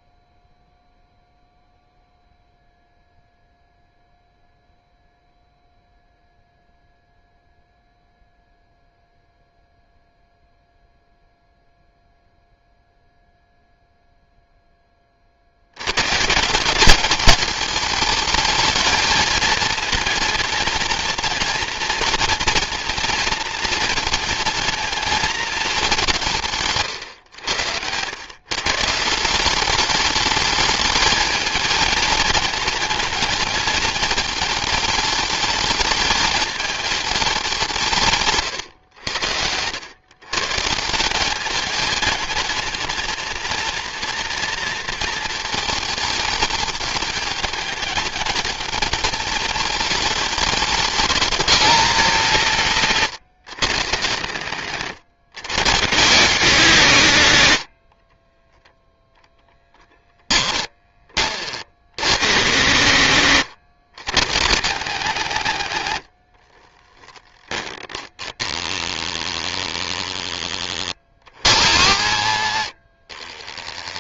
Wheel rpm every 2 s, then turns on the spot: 0, 0, 0, 0, 0, 0, 0, 10, 190, 220, 230, 230, 230, 140, 150, 210, 220, 220, 220, 100, 160, 220, 230, 210, 220, 210, 160, 140, 160, 0, 20, 130, 180, 30, 10, 30, 50.
26-28 66-68